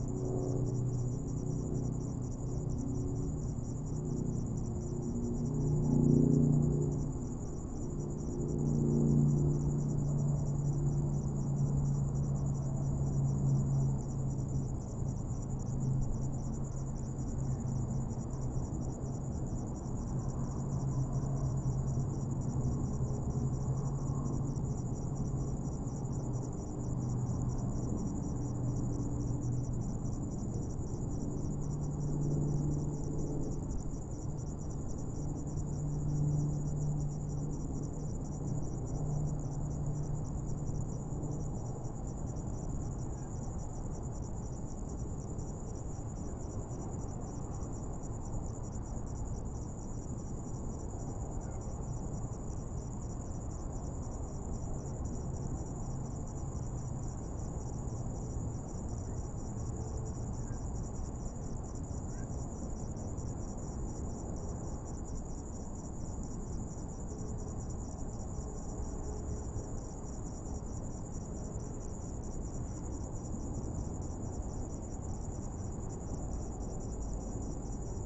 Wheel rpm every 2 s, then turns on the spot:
0, 0, 0, 0, 0, 0, 0, 0, 0, 0, 0, 0, 0, 0, 0, 0, 0, 0, 0, 0, 0, 0, 0, 0, 0, 0, 0, 0, 0, 0, 0, 0, 0, 0, 0, 0, 0, 0, 0.
none